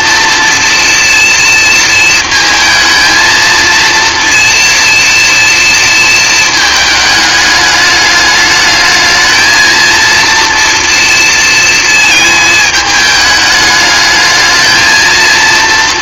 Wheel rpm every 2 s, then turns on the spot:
230, 230, 230, 210, 220, 230, 210, 230.
none